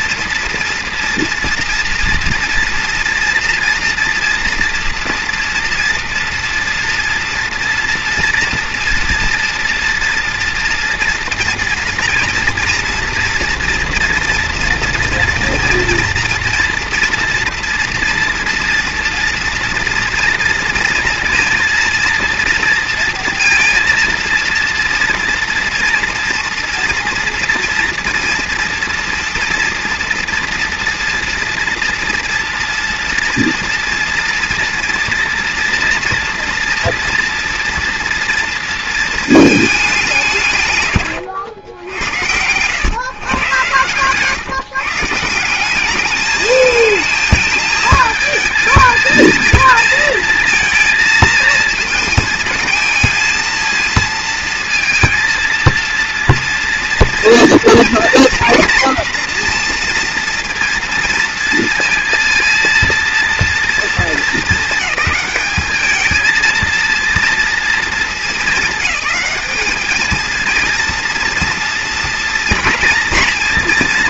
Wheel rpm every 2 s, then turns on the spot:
230, 230, 230, 230, 230, 230, 230, 230, 230, 240, 230, 230, 230, 230, 230, 240, 230, 240, 240, 230, 140, 100, 150, 220, 220, 220, 220, 230, 240, 240, 230, 230, 220, 230, 190, 230, 230.
none